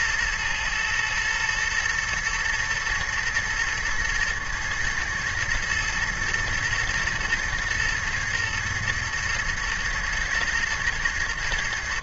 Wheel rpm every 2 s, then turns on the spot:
120, 110, 110, 110, 120, 120.
none